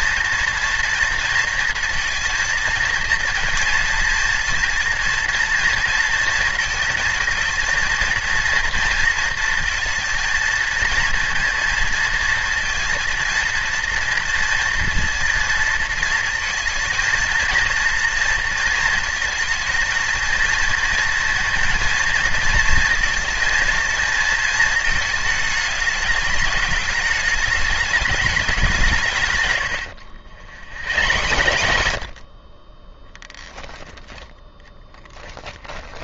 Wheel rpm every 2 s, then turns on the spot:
230, 230, 230, 230, 230, 230, 230, 230, 230, 230, 230, 230, 220, 210, 180, 100, 20, 10.
30-32 34-36